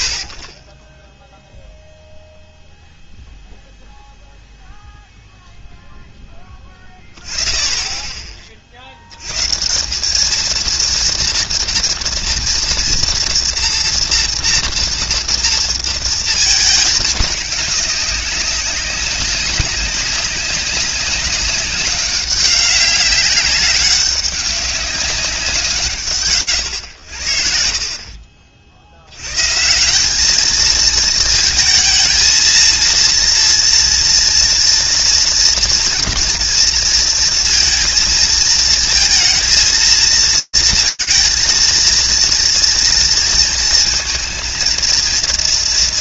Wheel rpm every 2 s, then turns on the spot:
40, 0, 0, 10, 20, 220, 230, 230, 220, 200, 200, 190, 200, 100, 50, 210, 230, 230, 230, 230, 230, 230, 230.
none